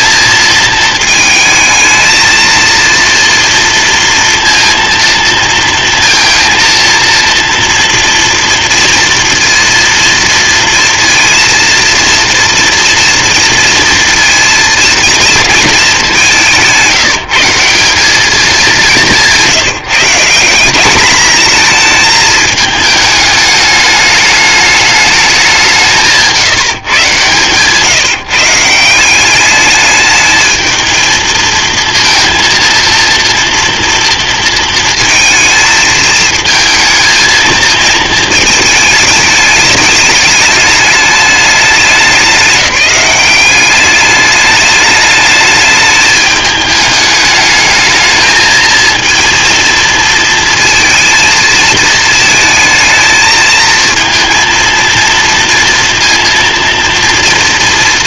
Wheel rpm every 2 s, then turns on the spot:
230, 230, 230, 230, 230, 230, 230, 230, 190, 200, 190, 220, 210, 150, 170, 220, 230, 230, 230, 220, 210, 200, 210, 210, 220, 230, 220, 230, 230.
none